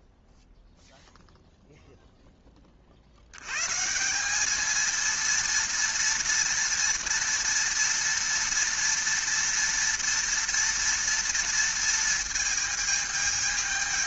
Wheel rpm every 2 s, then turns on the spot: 0, 30, 220, 230, 230, 230, 220.
none